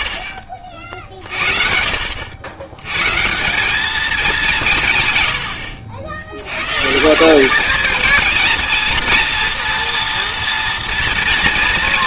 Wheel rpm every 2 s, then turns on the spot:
50, 90, 170, 120, 220, 230.
none